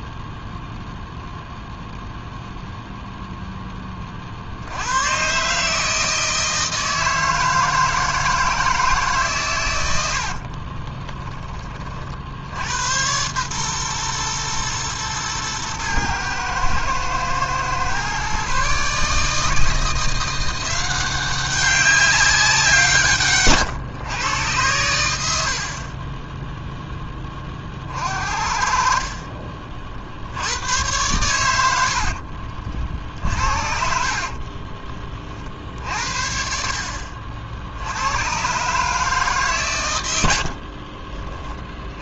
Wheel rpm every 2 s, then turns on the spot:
0, 0, 90, 160, 160, 40, 80, 120, 110, 140, 180, 170, 100, 10, 50, 100, 50, 30, 60, 130, 60.
10-12 34-36 40-42